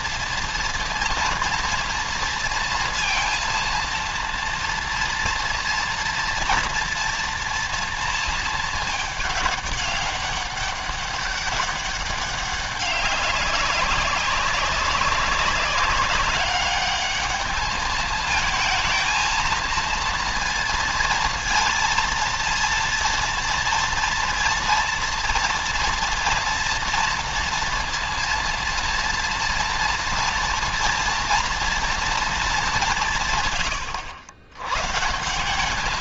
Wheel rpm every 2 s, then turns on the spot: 240, 230, 230, 230, 220, 200, 200, 200, 210, 220, 230, 230, 230, 230, 230, 230, 200, 120.
none